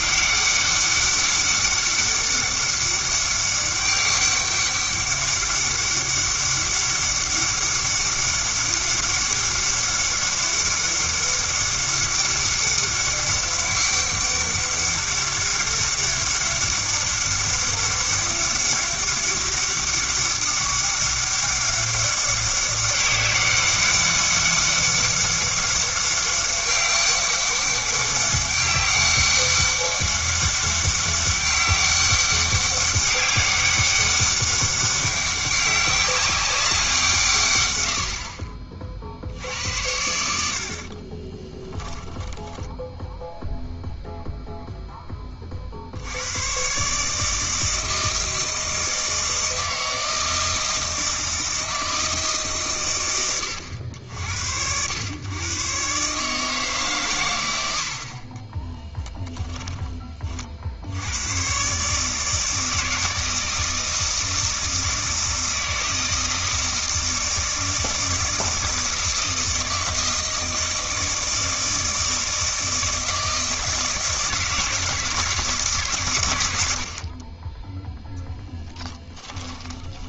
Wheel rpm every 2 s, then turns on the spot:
200, 200, 200, 200, 200, 200, 200, 200, 200, 200, 200, 200, 200, 200, 200, 200, 200, 200, 190, 40, 60, 10, 0, 130, 160, 160, 130, 100, 150, 20, 60, 160, 160, 160, 160, 160, 160, 160, 70, 10.
42-44 58-60 78-80